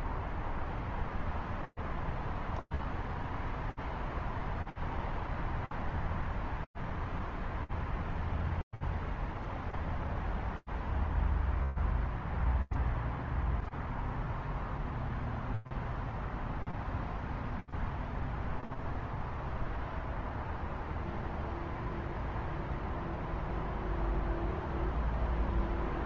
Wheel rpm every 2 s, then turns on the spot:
0, 0, 0, 0, 0, 0, 0, 0, 0, 0, 0, 0, 0.
none